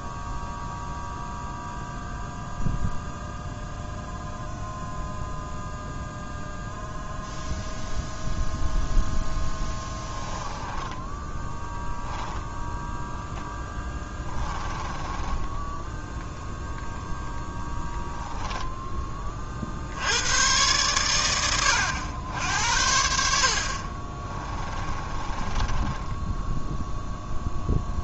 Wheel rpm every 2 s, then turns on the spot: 0, 0, 0, 0, 0, 10, 0, 10, 0, 10, 110, 80, 20, 0.
10-12 14-16 24-26